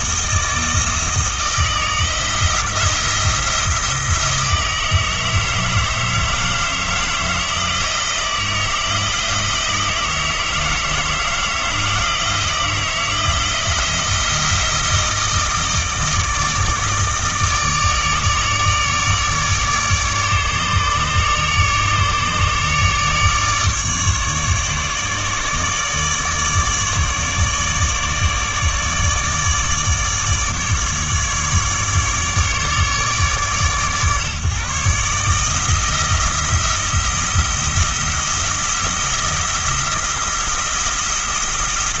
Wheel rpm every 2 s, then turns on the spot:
160, 170, 160, 160, 170, 160, 160, 160, 160, 150, 150, 150, 150, 150, 150, 150, 150, 150, 170, 170, 170.
none